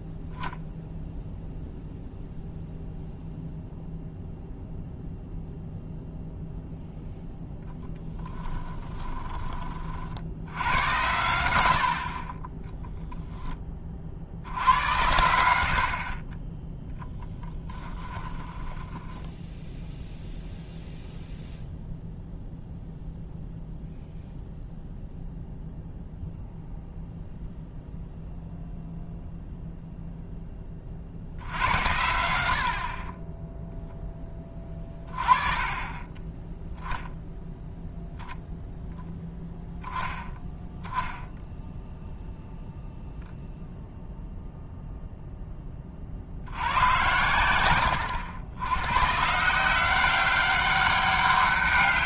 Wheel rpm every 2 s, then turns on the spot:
0, 0, 0, 0, 10, 90, 10, 80, 10, 10, 0, 0, 0, 0, 0, 20, 60, 20, 0, 0, 0, 0, 0, 90, 100, 200.
8-10 18-20